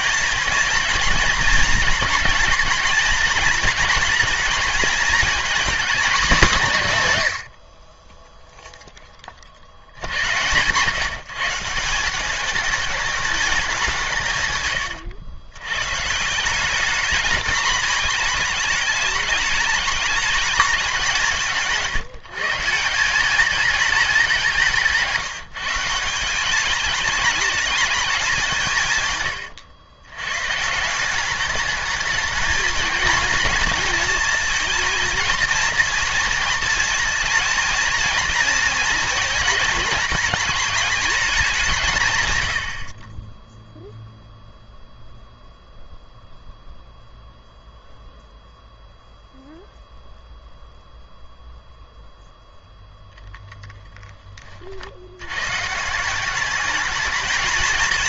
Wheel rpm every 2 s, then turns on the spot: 230, 230, 230, 210, 0, 130, 200, 130, 190, 220, 210, 170, 170, 200, 170, 150, 230, 230, 230, 230, 210, 80, 0, 0, 0, 0, 0, 40, 210.
none